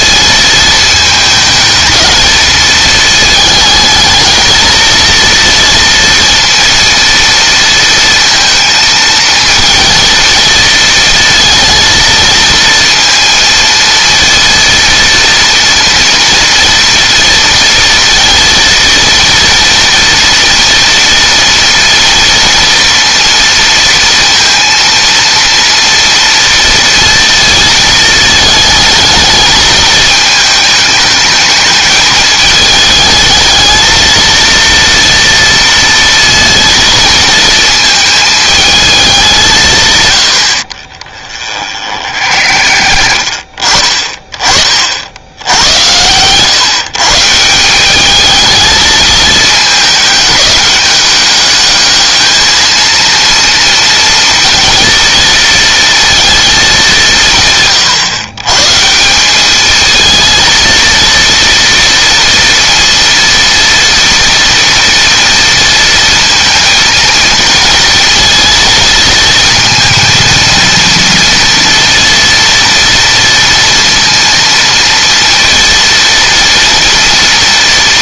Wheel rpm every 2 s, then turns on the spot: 220, 220, 230, 230, 220, 230, 230, 230, 230, 230, 230, 230, 230, 230, 220, 210, 220, 230, 230, 200, 40, 60, 60, 140, 220, 200, 220, 230, 190, 150, 230, 230, 230, 220, 230, 230, 230, 230, 230.
40-42